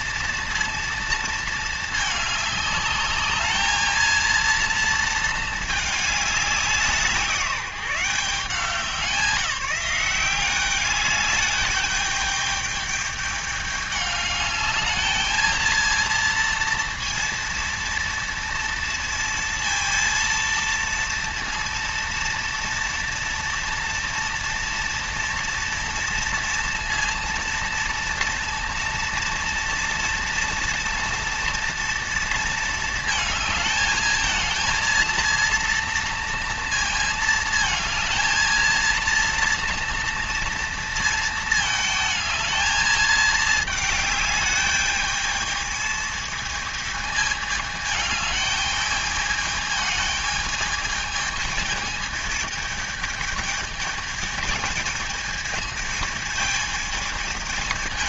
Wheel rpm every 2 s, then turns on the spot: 230, 210, 230, 200, 170, 190, 210, 210, 230, 230, 230, 230, 230, 230, 230, 230, 220, 220, 230, 230, 230, 220, 210, 220, 210, 210, 220, 220, 220.
none